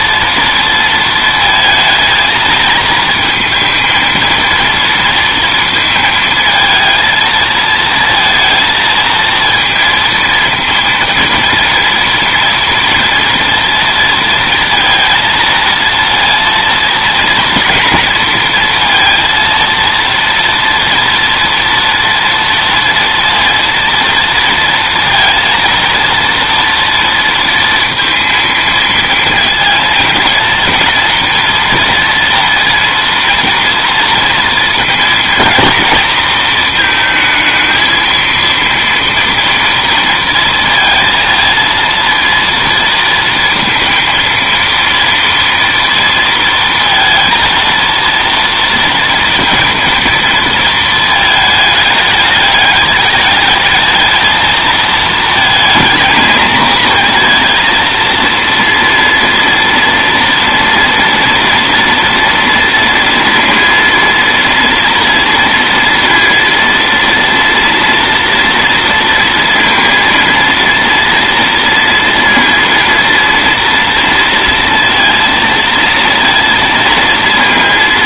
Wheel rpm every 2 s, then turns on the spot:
230, 220, 230, 230, 230, 230, 230, 230, 230, 230, 230, 230, 230, 230, 230, 230, 230, 230, 220, 230, 230, 230, 230, 230, 230, 230, 210, 220, 220, 230, 230, 230, 230, 230, 230, 230, 230, 230, 230.
none